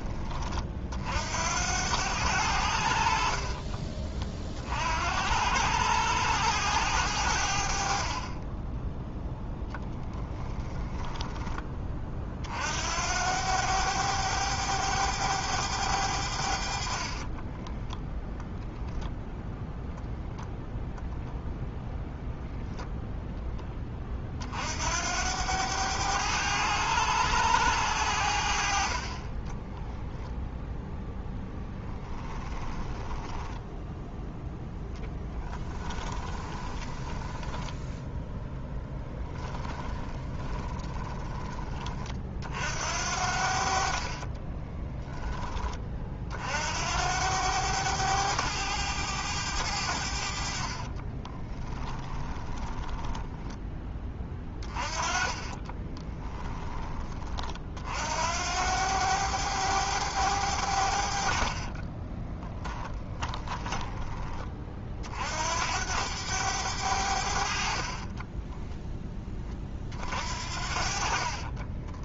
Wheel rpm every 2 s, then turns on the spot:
60, 70, 70, 100, 10, 10, 70, 100, 50, 0, 0, 0, 80, 100, 40, 0, 10, 0, 10, 10, 20, 70, 20, 70, 100, 30, 20, 30, 20, 90, 70, 20, 40, 90, 20, 50.
10-12 16-18 32-34 36-42 50-56 62-64 68-72